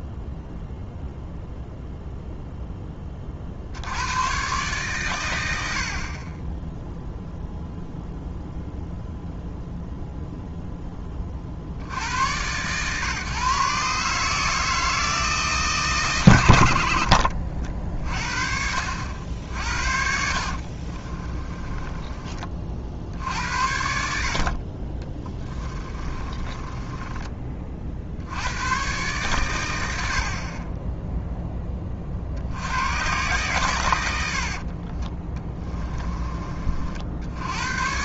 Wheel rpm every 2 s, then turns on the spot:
0, 30, 120, 0, 0, 70, 140, 150, 50, 60, 20, 60, 20, 30, 120, 0, 120, 20, 80.
20-22 24-26 34-36